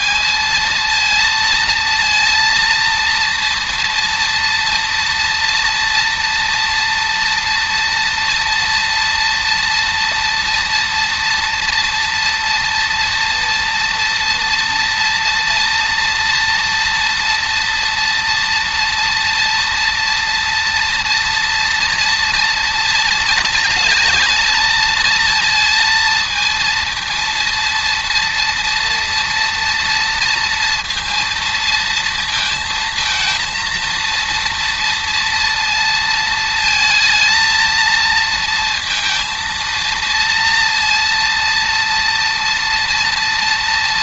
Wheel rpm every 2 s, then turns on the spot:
230, 230, 230, 230, 230, 230, 240, 230, 230, 230, 220, 220, 230, 230, 230, 230, 230, 230, 230, 230, 230, 230.
none